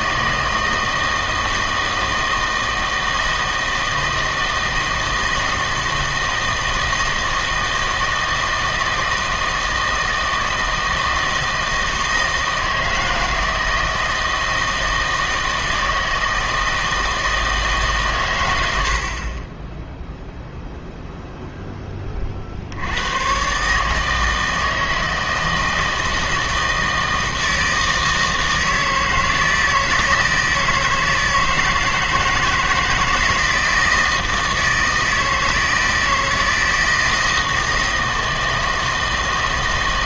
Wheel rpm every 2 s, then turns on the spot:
160, 160, 160, 160, 160, 160, 160, 160, 160, 90, 0, 80, 160, 160, 160, 160, 160, 160, 160, 160.
none